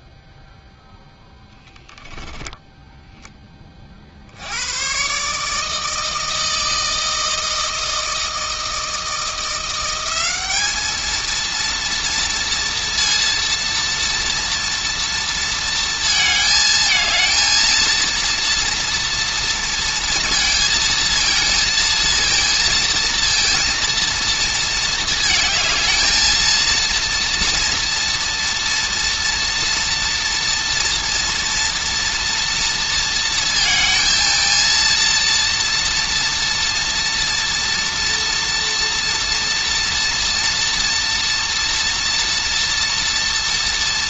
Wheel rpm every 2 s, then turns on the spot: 0, 10, 70, 160, 160, 190, 230, 230, 220, 230, 230, 230, 230, 220, 230, 230, 230, 230, 230, 230, 230, 230.
2-4